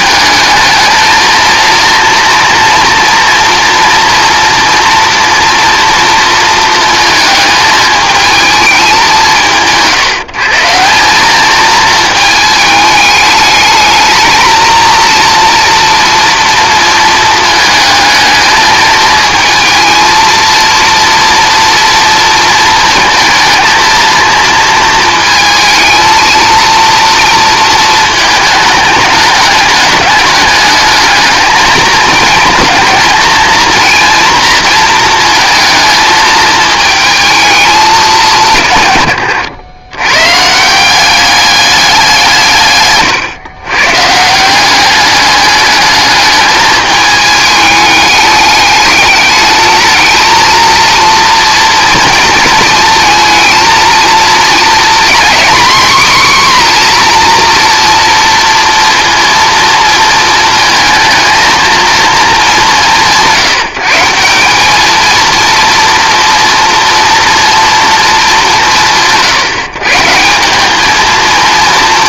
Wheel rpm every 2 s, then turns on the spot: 220, 230, 230, 230, 200, 170, 220, 230, 230, 220, 230, 230, 230, 230, 210, 210, 220, 230, 220, 140, 170, 130, 190, 210, 210, 230, 230, 230, 250, 230, 220, 190, 200, 230, 180, 220.
42-44